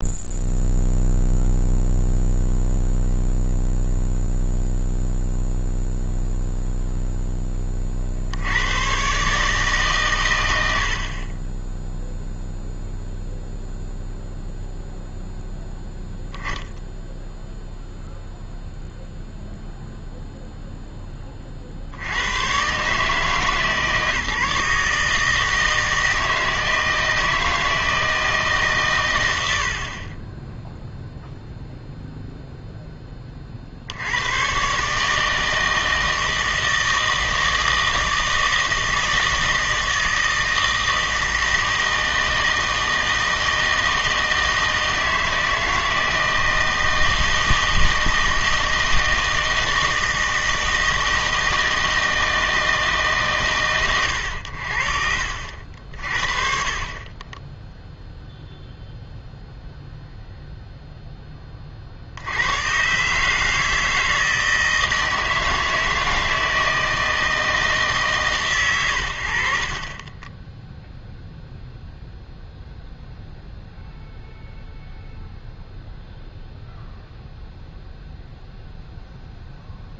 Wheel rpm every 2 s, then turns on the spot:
0, 0, 0, 0, 100, 80, 0, 0, 0, 0, 0, 130, 150, 160, 130, 0, 0, 130, 160, 160, 160, 160, 160, 160, 160, 160, 160, 70, 40, 0, 0, 130, 160, 160, 110, 0, 0, 0, 0, 0.
none